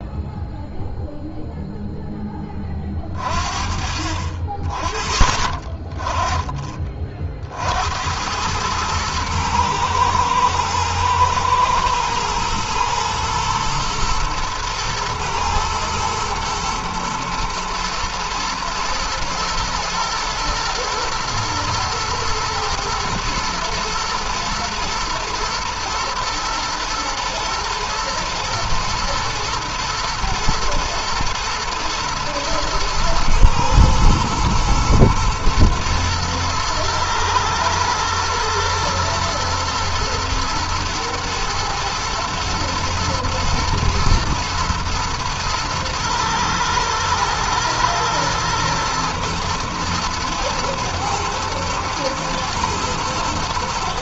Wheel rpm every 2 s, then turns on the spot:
0, 20, 30, 20, 100, 110, 110, 110, 110, 110, 120, 110, 110, 110, 120, 120, 110, 120, 110, 120, 120, 110, 120, 110, 110, 110, 120.
none